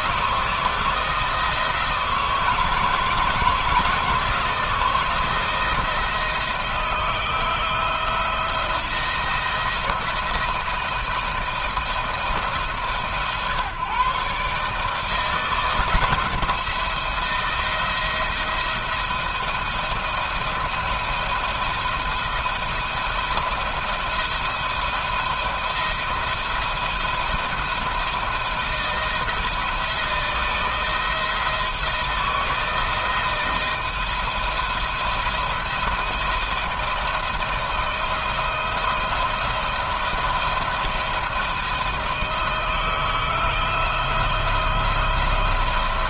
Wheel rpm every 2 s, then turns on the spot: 170, 170, 170, 170, 170, 170, 150, 150, 170, 170, 170, 170, 170, 170, 170, 160, 170, 170, 160, 160, 170, 160, 170.
none